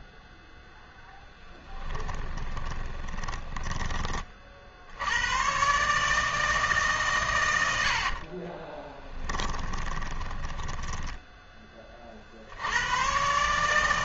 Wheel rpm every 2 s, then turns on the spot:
0, 10, 60, 150, 20, 10, 90.
2-4 8-12